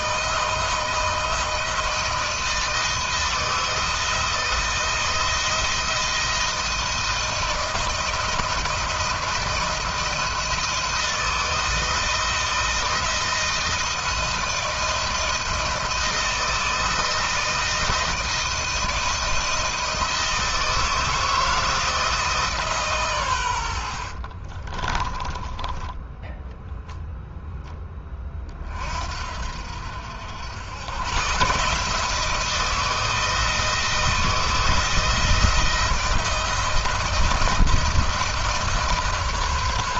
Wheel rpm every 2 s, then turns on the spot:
160, 160, 160, 160, 170, 170, 160, 160, 170, 160, 160, 140, 30, 0, 40, 100, 170, 160, 160, 160.
24-26